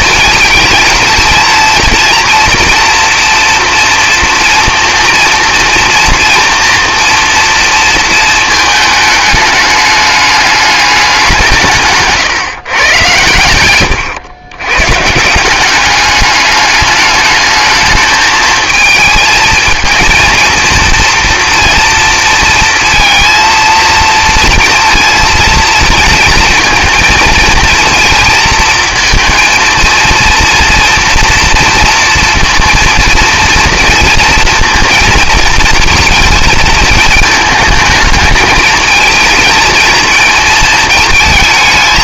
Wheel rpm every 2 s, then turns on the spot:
230, 230, 240, 240, 220, 210, 130, 120, 200, 220, 230, 230, 230, 230, 230, 230, 230, 230, 220, 220, 220.
none